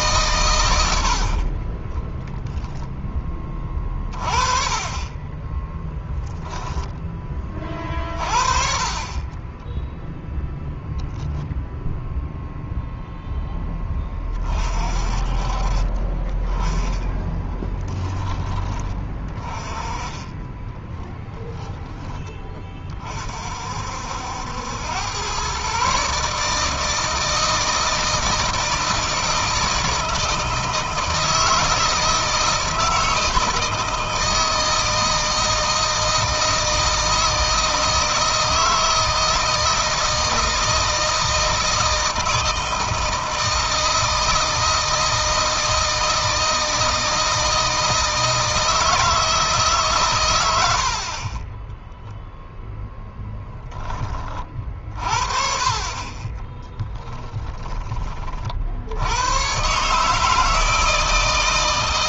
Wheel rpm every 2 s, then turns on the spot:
90, 10, 30, 10, 40, 0, 0, 40, 10, 20, 10, 30, 100, 160, 160, 160, 160, 160, 160, 160, 160, 160, 160, 160, 160, 80, 0, 40, 20, 70, 160.
20-22 56-58